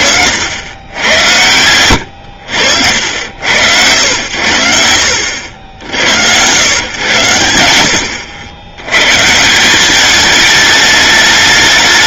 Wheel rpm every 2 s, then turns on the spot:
90, 80, 80, 110, 110, 210.
none